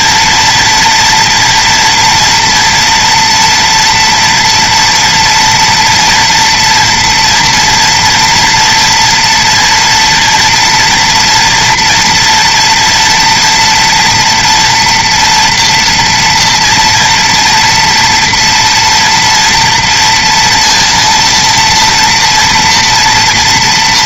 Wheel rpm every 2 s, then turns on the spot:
230, 240, 230, 230, 230, 230, 230, 230, 230, 230, 230, 230.
none